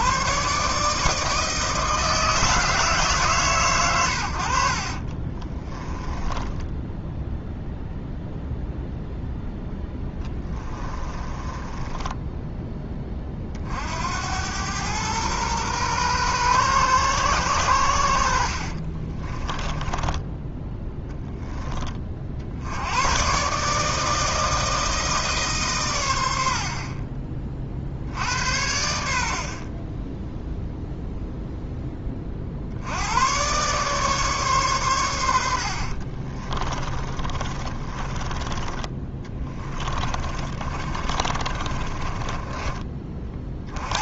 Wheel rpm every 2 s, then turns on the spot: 150, 150, 40, 10, 0, 30, 20, 110, 120, 30, 10, 90, 160, 50, 80, 0, 80, 110, 30, 20, 30, 30.
4-8 10-12 18-20 36-42